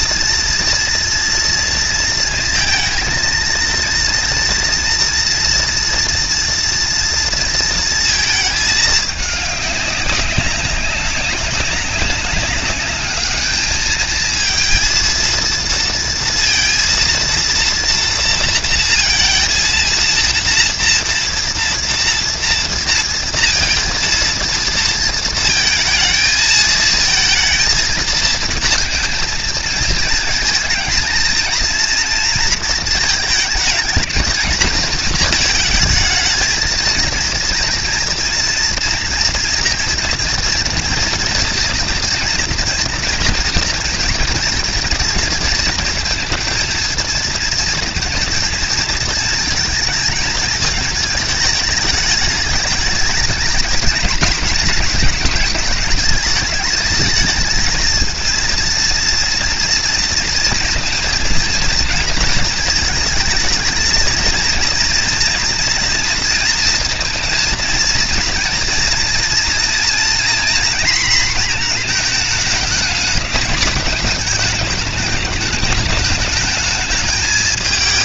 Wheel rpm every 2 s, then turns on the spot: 230, 230, 240, 230, 210, 200, 210, 230, 230, 230, 230, 230, 230, 220, 230, 220, 220, 220, 230, 230, 230, 230, 220, 220, 230, 220, 220, 220, 210, 230, 230, 220, 230, 230, 230, 240, 220, 210, 220.
none